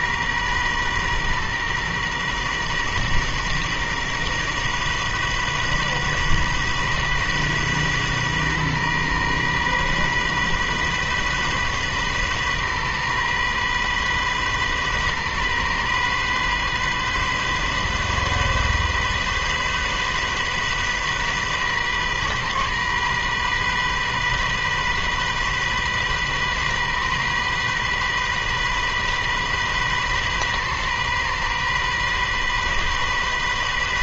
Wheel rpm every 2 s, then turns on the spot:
120, 120, 120, 130, 130, 130, 130, 130, 130, 130, 130, 130, 130, 130, 130, 130, 130.
none